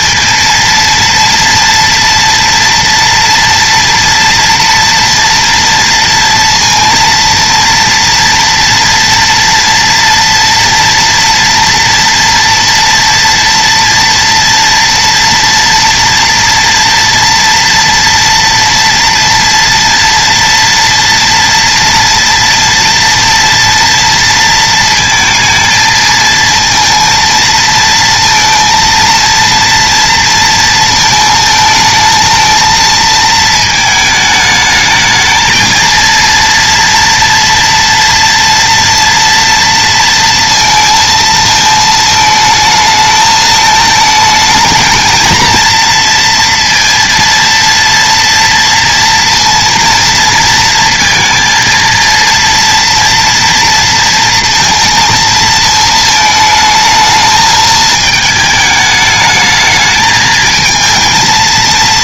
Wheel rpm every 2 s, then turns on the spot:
230, 230, 230, 230, 230, 230, 230, 240, 230, 230, 230, 230, 230, 230, 230, 230, 220, 220, 230, 230, 230, 220, 220, 230, 230, 230, 230, 230, 220, 220, 220.
none